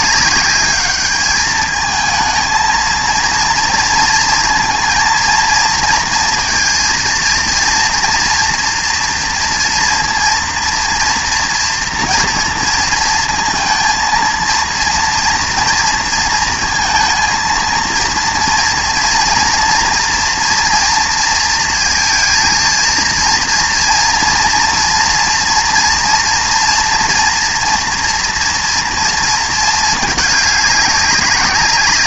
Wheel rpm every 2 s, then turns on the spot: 200, 230, 230, 230, 240, 230, 230, 230, 230, 230, 230, 230, 230, 240, 240, 210.
none